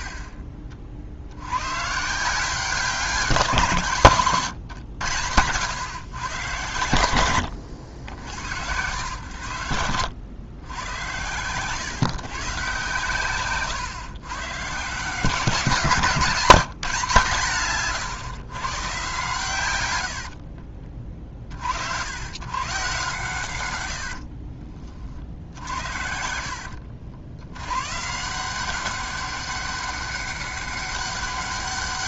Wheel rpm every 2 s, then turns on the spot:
40, 190, 100, 100, 100, 100, 120, 150, 180, 130, 30, 130, 40, 80, 190, 200.
none